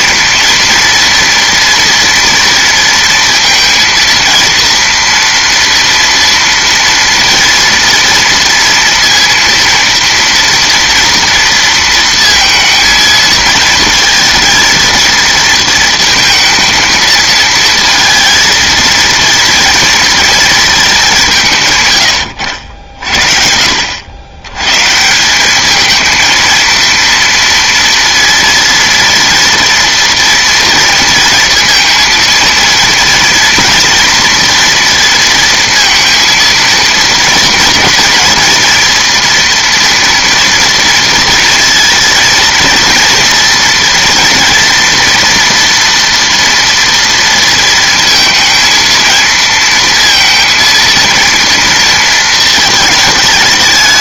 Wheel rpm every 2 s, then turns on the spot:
230, 230, 230, 230, 230, 230, 230, 230, 220, 230, 220, 80, 130, 230, 230, 230, 230, 230, 230, 230, 230, 230, 230, 230, 230, 230, 220.
none